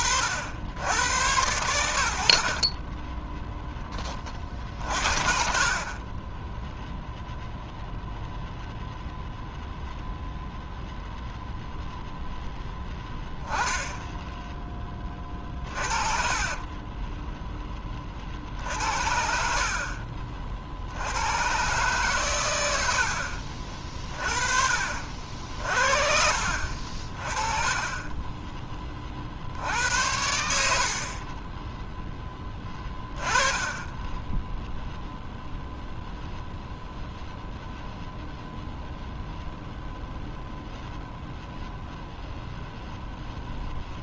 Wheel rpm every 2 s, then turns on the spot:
80, 40, 40, 0, 0, 0, 0, 10, 30, 50, 60, 90, 40, 50, 20, 70, 20, 0, 0, 0, 0, 0.
2-4 16-18 30-34